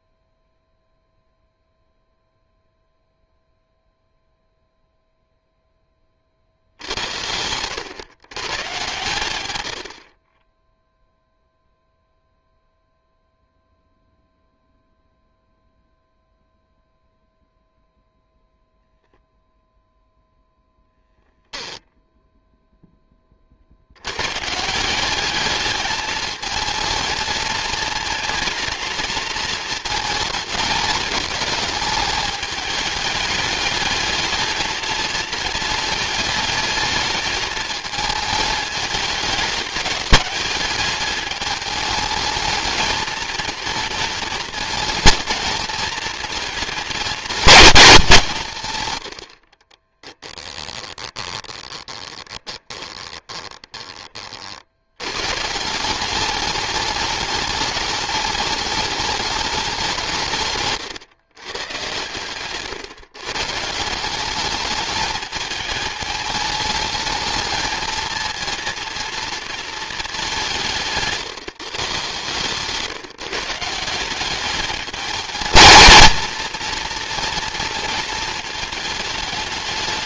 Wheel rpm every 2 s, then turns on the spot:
0, 0, 0, 70, 140, 10, 0, 0, 0, 0, 0, 0, 160, 220, 230, 210, 220, 220, 220, 210, 210, 220, 230, 220, 120, 10, 20, 70, 210, 210, 140, 120, 210, 220, 230, 170, 150, 210, 230, 220.
6-8 50-54